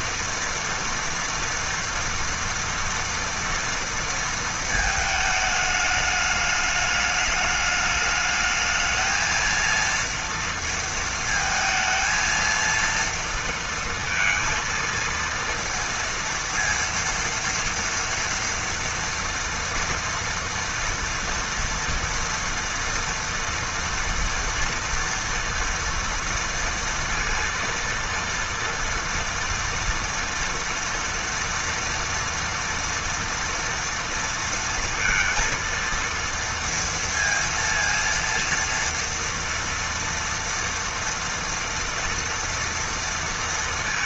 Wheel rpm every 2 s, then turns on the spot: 230, 240, 220, 210, 210, 230, 230, 230, 230, 230, 230, 230, 230, 230, 230, 240, 230, 230, 230, 230, 230, 230.
none